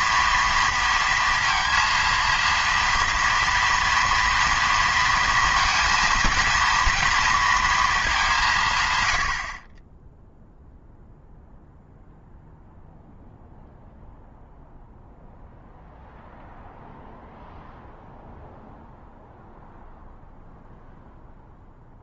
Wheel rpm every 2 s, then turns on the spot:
230, 230, 230, 210, 20, 0, 0, 0, 0, 0, 0.
none